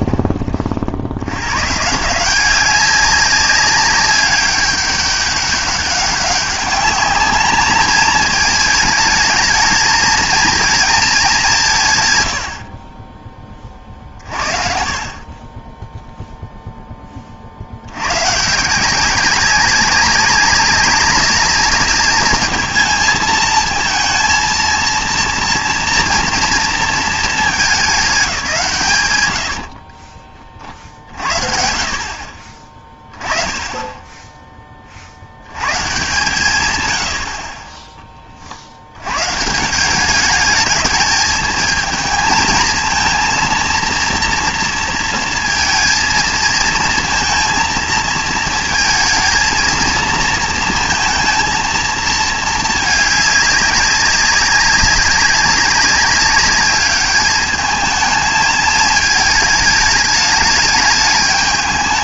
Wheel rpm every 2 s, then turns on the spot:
30, 190, 200, 200, 220, 230, 90, 40, 0, 150, 200, 210, 230, 230, 180, 40, 30, 20, 120, 60, 210, 230, 230, 230, 230, 230, 220, 200, 200, 220, 210.
none